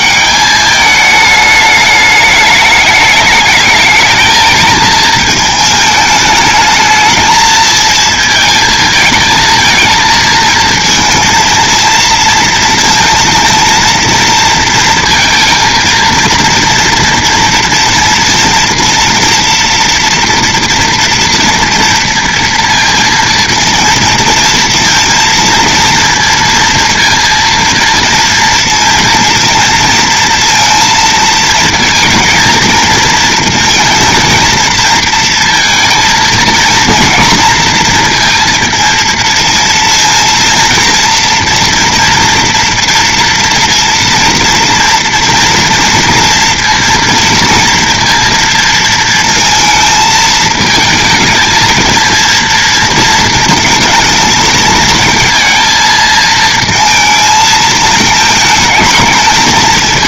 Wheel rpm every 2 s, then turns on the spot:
210, 210, 210, 220, 220, 230, 220, 230, 230, 230, 230, 230, 230, 230, 230, 230, 220, 220, 230, 230, 230, 230, 230, 230, 230, 220, 230, 220, 220, 220.
none